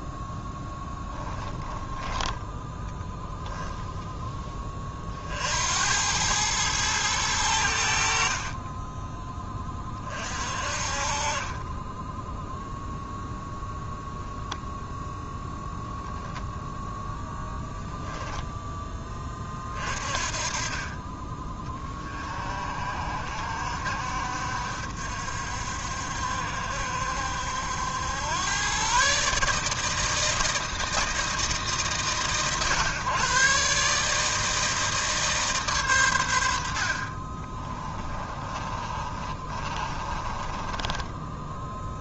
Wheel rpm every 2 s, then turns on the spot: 10, 10, 30, 110, 20, 40, 0, 0, 10, 10, 40, 60, 60, 60, 130, 160, 130, 160, 50, 40, 20.
0-2 36-42